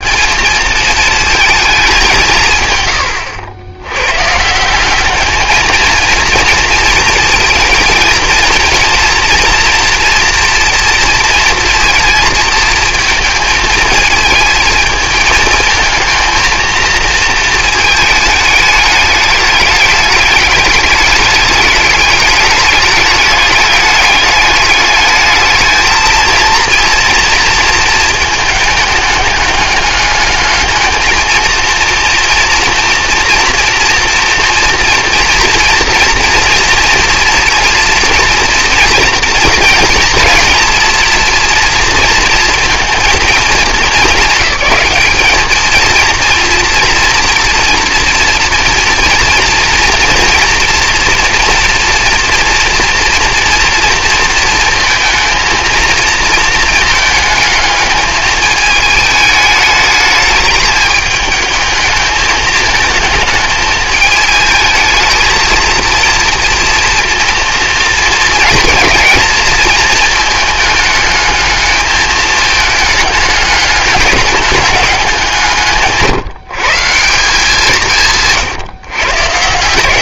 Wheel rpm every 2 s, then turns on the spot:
220, 110, 200, 230, 230, 230, 220, 220, 230, 210, 210, 210, 210, 230, 210, 220, 230, 240, 230, 230, 230, 230, 210, 230, 230, 240, 230, 220, 220, 220, 210, 220, 220, 230, 220, 210, 210, 190, 160, 130.
none